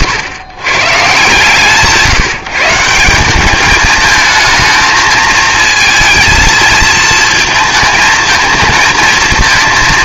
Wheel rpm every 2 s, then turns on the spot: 120, 160, 220, 230, 220.
none